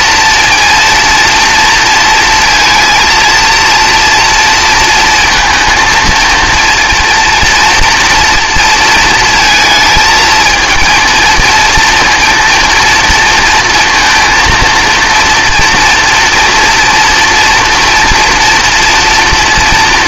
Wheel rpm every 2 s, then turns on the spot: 230, 230, 230, 230, 230, 220, 230, 230, 240, 230.
none